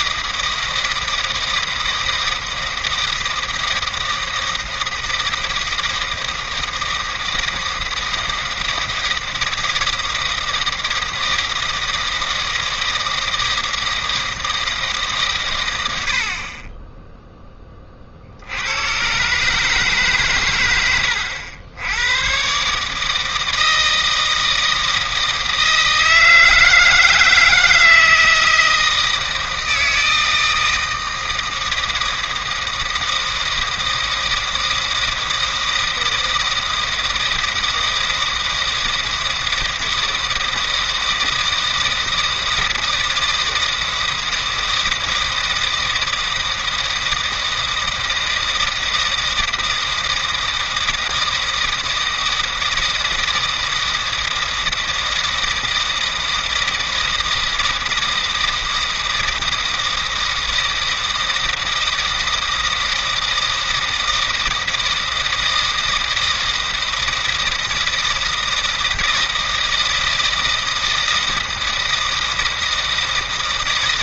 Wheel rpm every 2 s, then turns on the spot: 160, 160, 160, 160, 160, 160, 160, 160, 30, 80, 110, 130, 160, 160, 160, 160, 160, 160, 160, 160, 160, 160, 160, 160, 160, 160, 160, 160, 160, 160, 160, 160, 160, 160, 160, 160, 160.
none